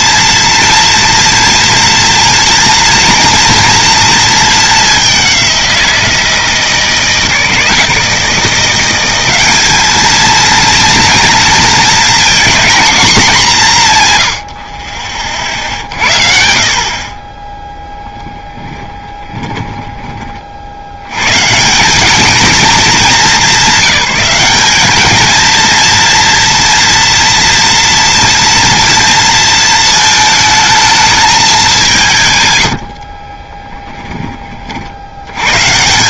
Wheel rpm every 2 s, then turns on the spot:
230, 240, 200, 160, 180, 240, 230, 40, 50, 20, 80, 210, 210, 230, 230, 220, 90, 60.
18-20 32-34